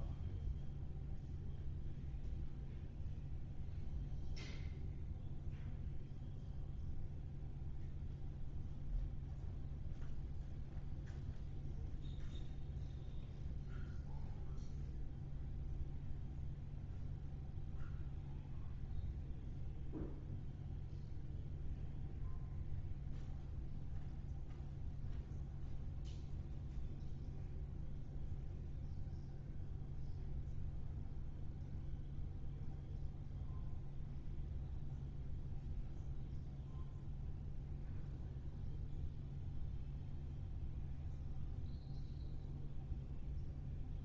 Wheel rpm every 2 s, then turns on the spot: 0, 0, 0, 0, 0, 0, 0, 0, 0, 0, 0, 0, 0, 0, 0, 0, 0, 0, 0, 0, 0, 0.
none